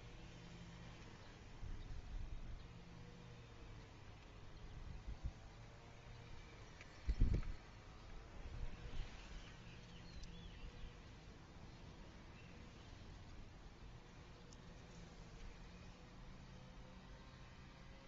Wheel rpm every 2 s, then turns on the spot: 0, 0, 0, 0, 0, 0, 0, 0, 0.
none